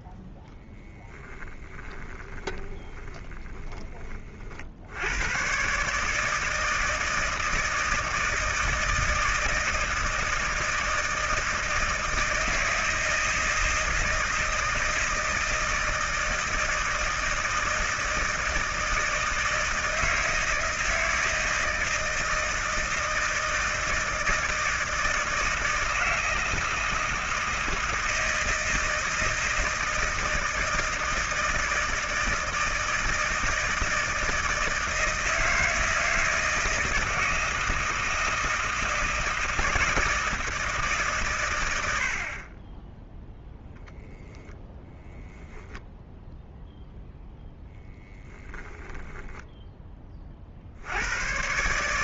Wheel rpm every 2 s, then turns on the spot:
20, 20, 80, 160, 160, 160, 160, 160, 160, 160, 160, 160, 160, 160, 160, 160, 160, 160, 160, 160, 150, 20, 10, 0, 10, 60.
0-4 48-50